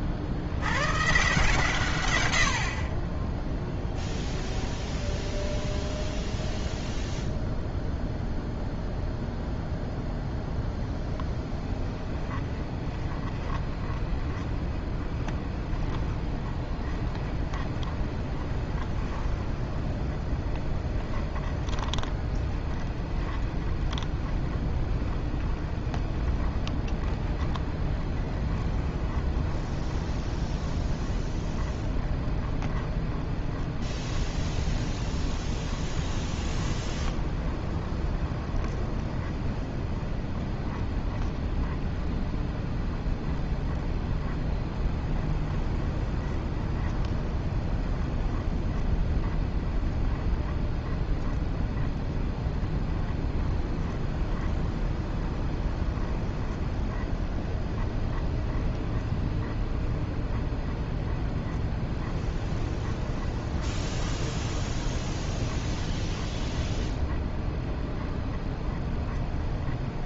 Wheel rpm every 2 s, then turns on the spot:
90, 60, 10, 0, 0, 0, 20, 20, 20, 20, 10, 20, 20, 20, 20, 20, 20, 20, 20, 20, 20, 20, 20, 20, 20, 20, 20, 20, 20, 20, 20, 20, 20, 20, 20.
4-6 12-70